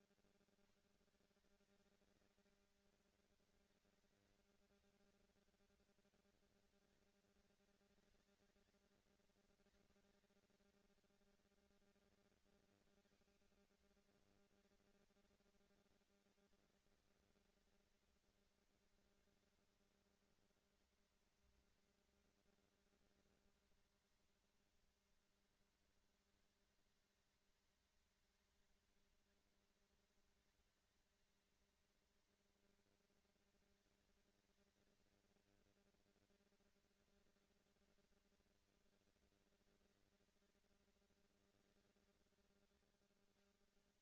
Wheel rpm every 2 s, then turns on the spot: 130, 220, 220, 220, 220, 220, 250, 230, 220, 220, 230, 230, 230, 210, 220, 210, 230, 220, 230, 230, 230, 180.
none